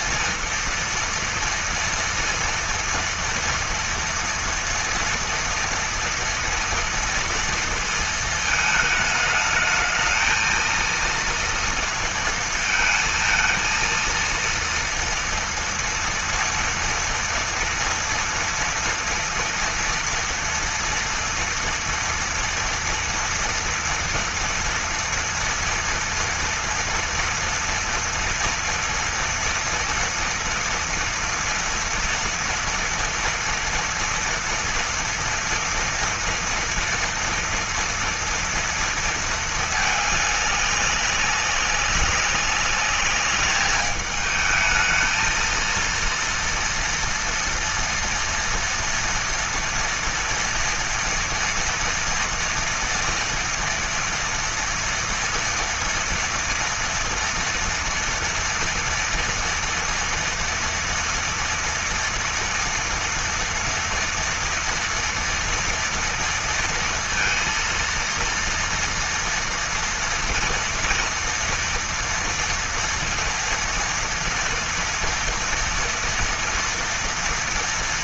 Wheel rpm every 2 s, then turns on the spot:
230, 230, 240, 230, 220, 230, 220, 230, 230, 230, 230, 240, 230, 230, 230, 230, 240, 230, 230, 230, 200, 200, 220, 230, 230, 230, 240, 230, 230, 230, 230, 230, 230, 230, 230, 230, 230, 230, 230.
none